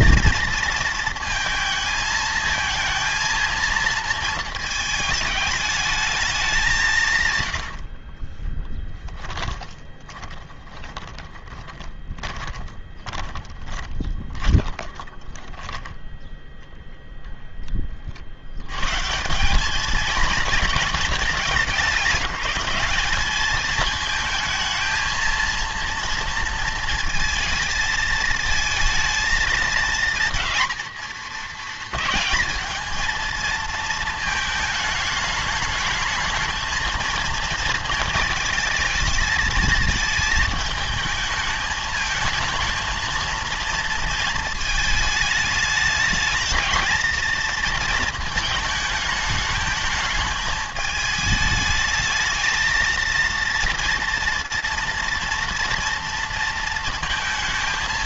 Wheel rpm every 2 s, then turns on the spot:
230, 220, 220, 190, 20, 10, 20, 20, 0, 100, 210, 200, 230, 230, 220, 230, 220, 220, 220, 220, 220, 220, 220, 220, 220, 210, 220, 230, 230.
8-16